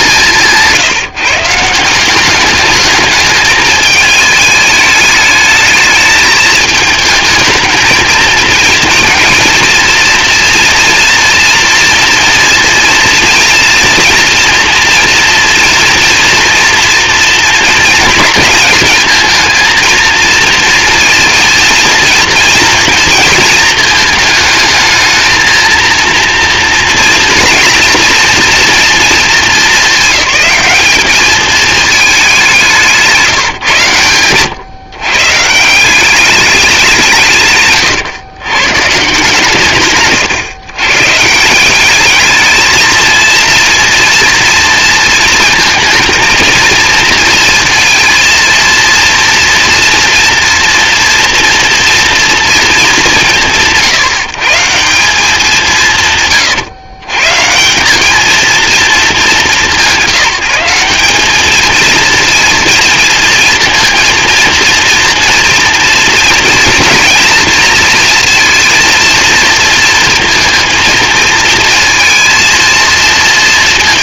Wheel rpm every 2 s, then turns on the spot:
160, 210, 210, 220, 230, 230, 230, 240, 230, 220, 230, 230, 220, 240, 230, 220, 160, 140, 150, 140, 140, 220, 230, 230, 230, 240, 190, 180, 130, 210, 190, 230, 240, 230, 230, 230, 230.
32-34